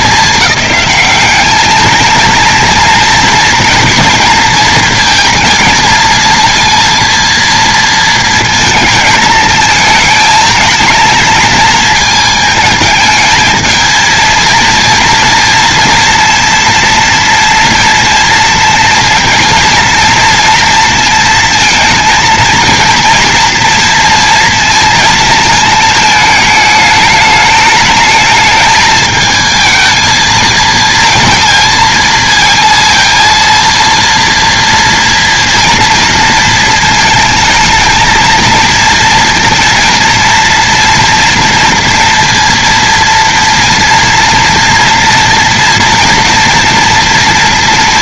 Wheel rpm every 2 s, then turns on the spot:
210, 220, 230, 230, 230, 220, 220, 230, 230, 230, 230, 230, 230, 210, 220, 220, 230, 230, 230, 230, 230, 230, 230, 230.
none